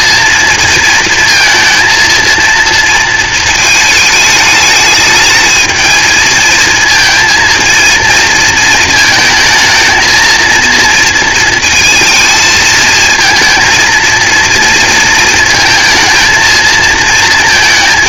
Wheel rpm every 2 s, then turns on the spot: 230, 230, 210, 230, 220, 230, 220, 230, 220.
none